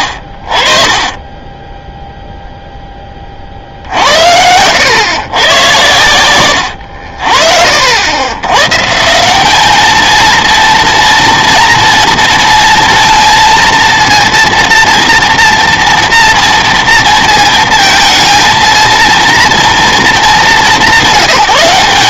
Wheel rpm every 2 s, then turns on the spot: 40, 0, 80, 80, 130, 230, 230, 230, 230, 230, 190.
none